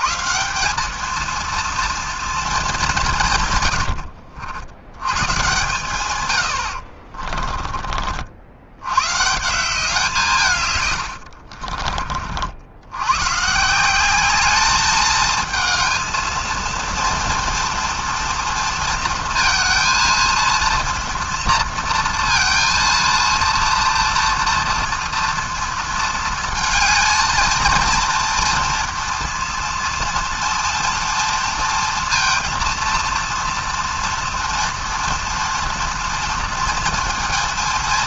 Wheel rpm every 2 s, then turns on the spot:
190, 210, 100, 60, 100, 120, 80, 210, 230, 230, 230, 230, 230, 220, 230, 230, 230, 240, 230.
6-8